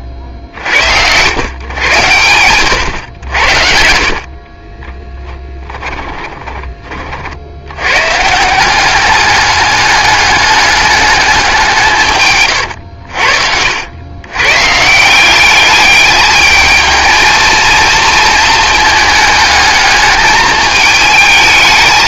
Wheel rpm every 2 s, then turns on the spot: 90, 100, 20, 30, 190, 210, 80, 150, 220, 220, 210.
4-6